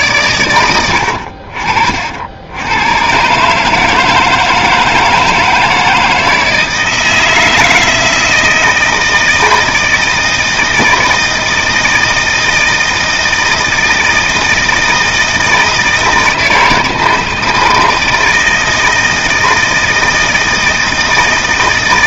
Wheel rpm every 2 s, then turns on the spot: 50, 140, 160, 160, 160, 160, 160, 160, 160, 160, 160.
none